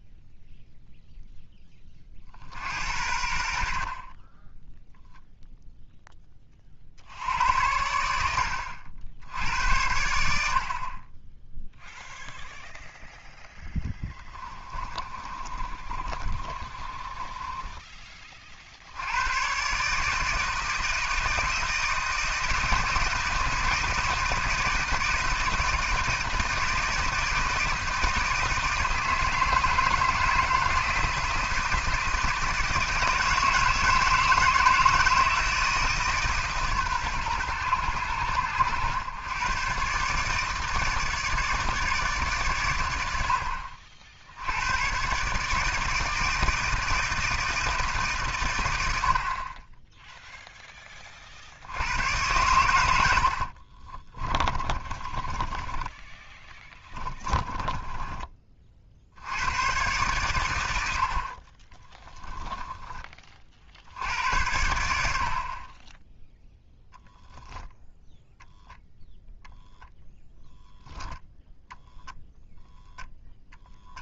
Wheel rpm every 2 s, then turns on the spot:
0, 70, 0, 50, 70, 50, 0, 20, 30, 60, 160, 160, 160, 160, 160, 160, 160, 160, 140, 100, 150, 110, 100, 160, 90, 20, 100, 30, 20, 50, 90, 10, 80, 10, 0, 0, 0.
14-18 54-58 66-68